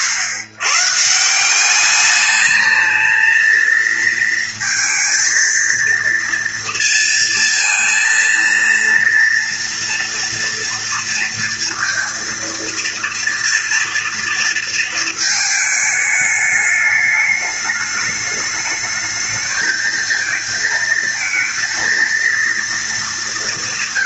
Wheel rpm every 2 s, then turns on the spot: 120, 220, 220, 230, 230, 230, 230, 230, 210, 210, 230, 220.
none